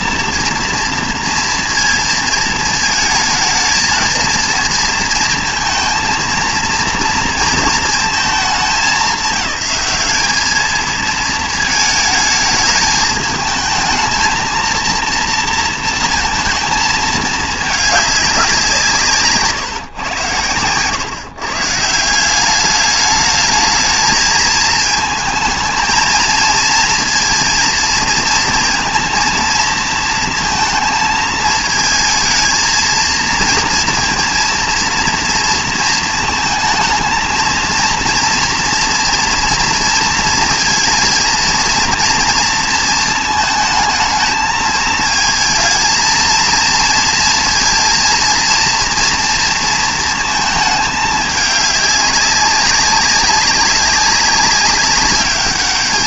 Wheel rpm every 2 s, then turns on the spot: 230, 220, 230, 230, 200, 220, 210, 230, 230, 190, 110, 200, 220, 230, 230, 230, 220, 230, 230, 230, 230, 230, 220, 230, 230, 220, 200, 200.
none